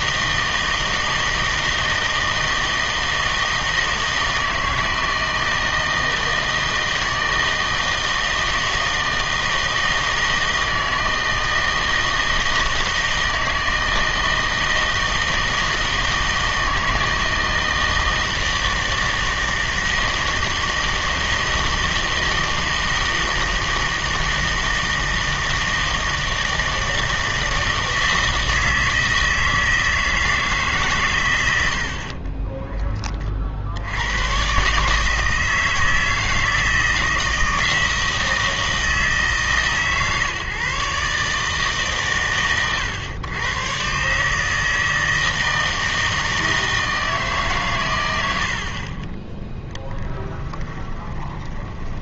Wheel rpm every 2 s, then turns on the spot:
160, 160, 160, 160, 160, 160, 160, 160, 160, 160, 160, 160, 160, 160, 160, 150, 20, 120, 160, 170, 140, 120, 160, 160, 60, 10.
32-34 50-52